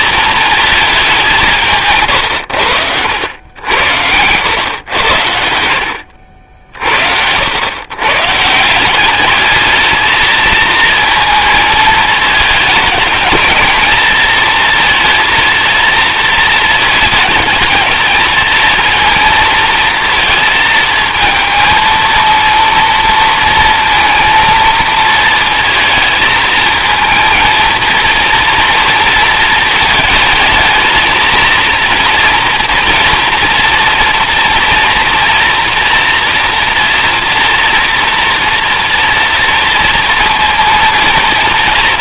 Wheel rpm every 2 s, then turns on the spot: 190, 90, 90, 80, 200, 230, 220, 230, 220, 230, 220, 230, 230, 220, 230, 220, 230, 240, 230, 230, 230.
4-6